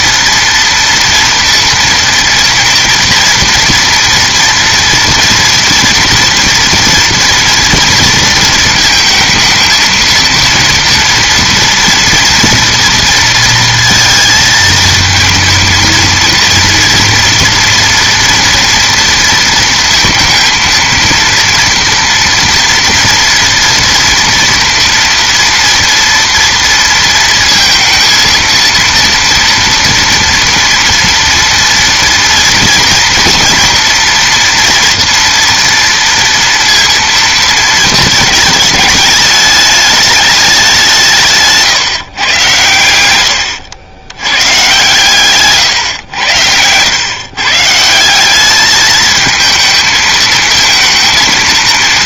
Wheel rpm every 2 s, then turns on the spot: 230, 230, 230, 230, 230, 230, 230, 230, 230, 230, 230, 240, 230, 230, 230, 230, 230, 230, 230, 210, 200, 120, 110, 100, 210, 220.
none